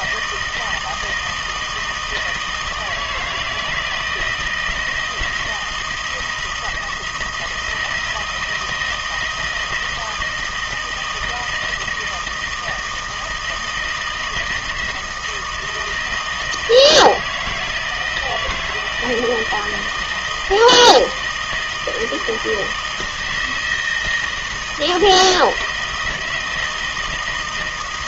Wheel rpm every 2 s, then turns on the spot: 160, 160, 160, 170, 160, 160, 160, 160, 160, 160, 160, 160, 160, 160.
none